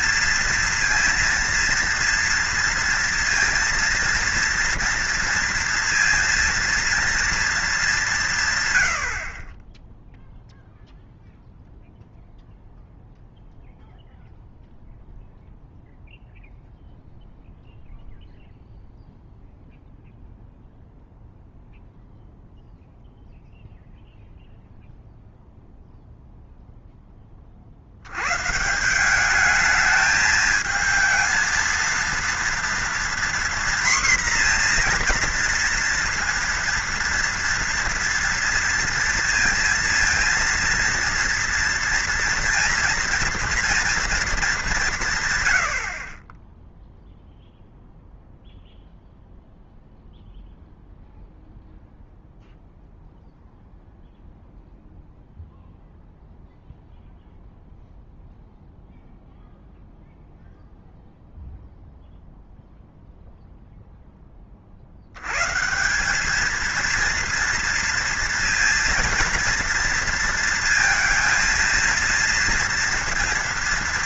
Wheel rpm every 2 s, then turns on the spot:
230, 230, 230, 230, 140, 0, 0, 0, 0, 0, 0, 0, 0, 0, 140, 220, 230, 240, 230, 230, 230, 230, 190, 0, 0, 0, 0, 0, 0, 0, 0, 0, 30, 220, 230, 230, 230.
none